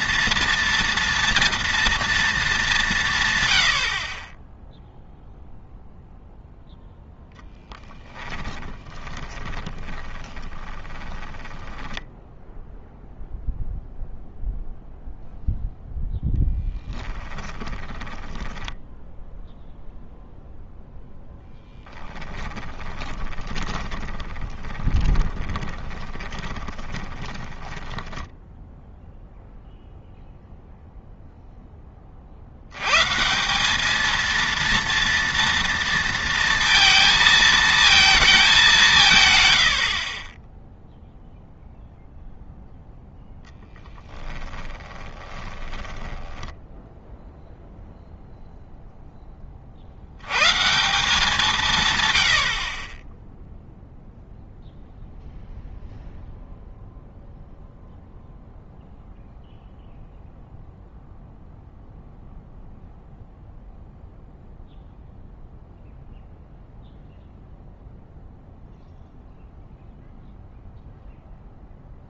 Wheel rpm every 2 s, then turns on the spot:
230, 190, 0, 0, 20, 20, 0, 0, 10, 10, 0, 10, 20, 20, 0, 0, 90, 230, 230, 190, 0, 0, 10, 10, 0, 160, 30, 0, 0, 0, 0, 0, 0, 0, 0, 0.
8-12 16-20 22-28 44-48